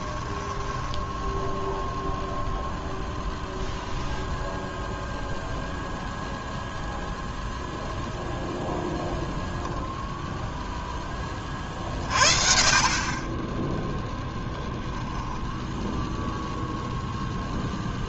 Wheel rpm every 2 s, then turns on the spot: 10, 0, 0, 0, 0, 0, 50, 10, 0.
0-2